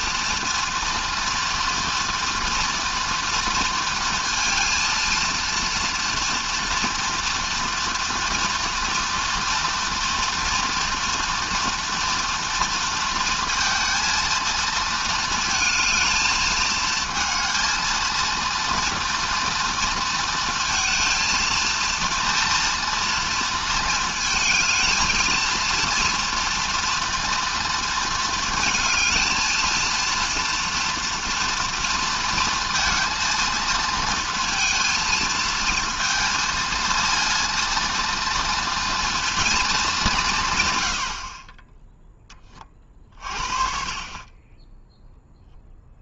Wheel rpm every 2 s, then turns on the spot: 230, 230, 230, 230, 230, 230, 230, 230, 220, 230, 230, 240, 220, 230, 230, 230, 230, 230, 230, 230, 120, 20, 20.
none